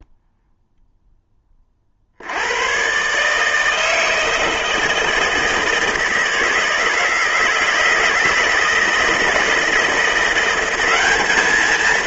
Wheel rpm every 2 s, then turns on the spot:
0, 120, 160, 160, 170, 200.
none